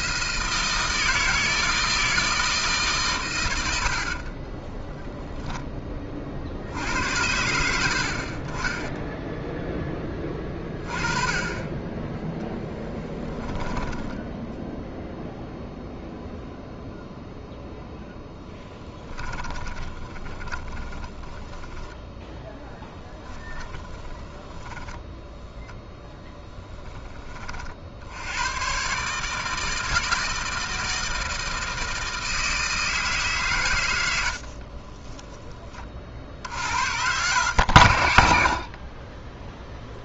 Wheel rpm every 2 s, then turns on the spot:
160, 160, 20, 60, 30, 20, 0, 0, 0, 10, 20, 0, 10, 10, 120, 160, 160, 50, 70, 60.
4-6 18-22 34-36